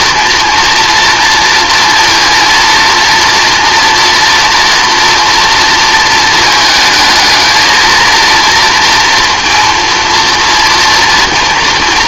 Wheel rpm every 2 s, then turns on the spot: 230, 230, 230, 220, 230, 230.
none